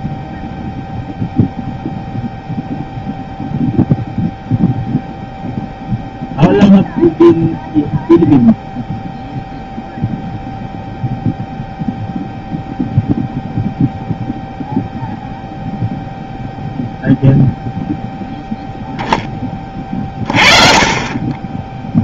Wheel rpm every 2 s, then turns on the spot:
0, 0, 0, 0, 0, 0, 0, 0, 0, 0, 30.
none